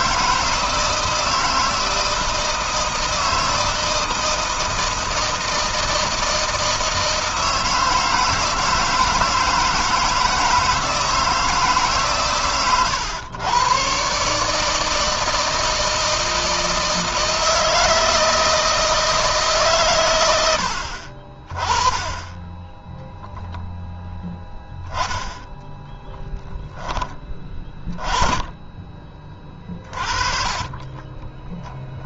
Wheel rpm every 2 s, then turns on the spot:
160, 160, 160, 160, 160, 160, 120, 150, 160, 160, 70, 0, 10, 10, 20, 20.
none